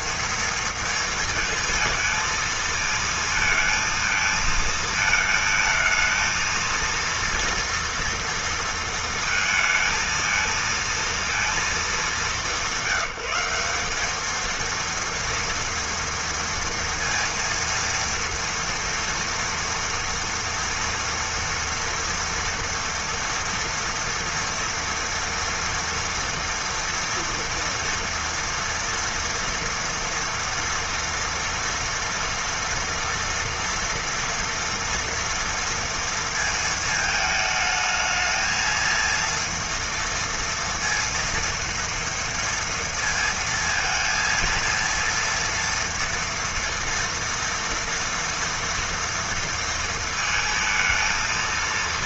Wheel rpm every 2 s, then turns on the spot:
230, 230, 220, 230, 230, 230, 190, 230, 230, 230, 230, 230, 230, 230, 230, 230, 230, 230, 220, 220, 230, 230, 230, 230, 230, 230.
none